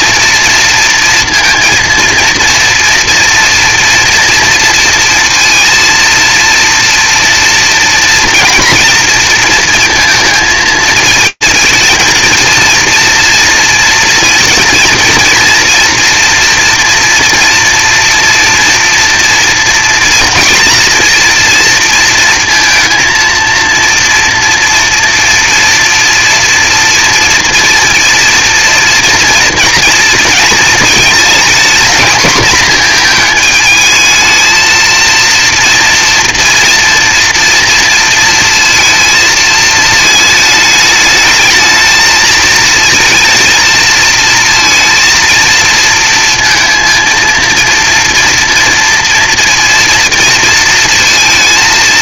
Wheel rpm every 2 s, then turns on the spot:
230, 230, 230, 230, 230, 220, 230, 230, 230, 230, 240, 230, 230, 230, 230, 230, 230, 230, 230, 230, 210, 220, 230, 230, 240, 230.
none